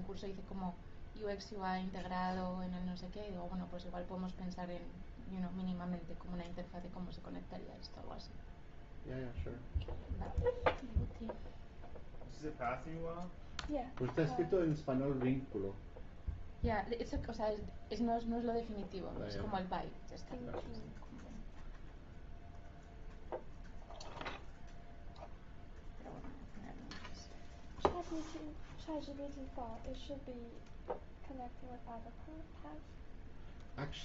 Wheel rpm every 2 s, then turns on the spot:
0, 0, 0, 0, 0, 0, 0, 0, 0, 0, 0, 0, 0, 0, 0, 0, 0.
none